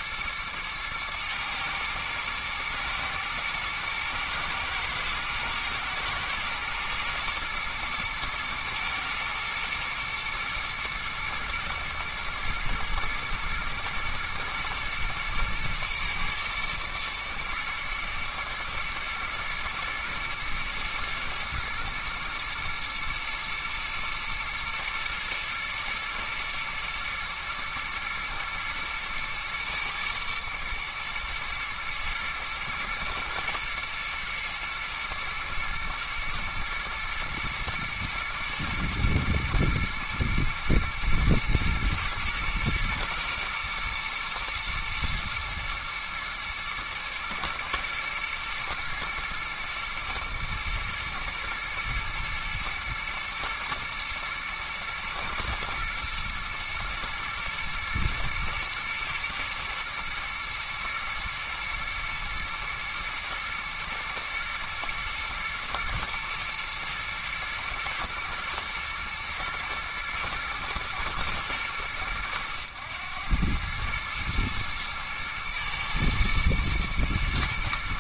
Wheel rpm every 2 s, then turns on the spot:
120, 110, 120, 110, 110, 110, 110, 120, 110, 110, 120, 110, 120, 110, 120, 110, 110, 120, 120, 120, 120, 120, 120, 110, 110, 110, 120, 110, 120, 110, 110, 110, 110, 110, 110, 110, 100, 110, 110.
none